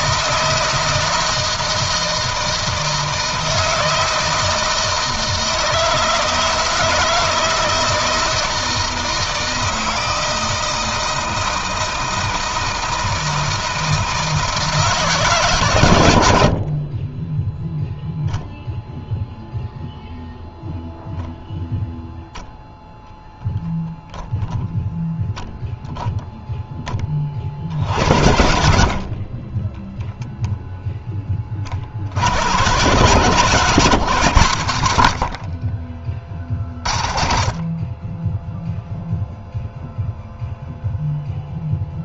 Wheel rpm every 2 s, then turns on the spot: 160, 160, 160, 160, 160, 160, 160, 150, 40, 0, 0, 0, 0, 10, 50, 10, 120, 100, 30, 0, 0.
none